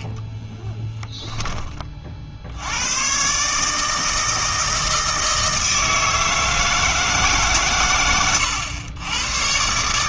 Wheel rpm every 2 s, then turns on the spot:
10, 90, 160, 160, 100.
0-2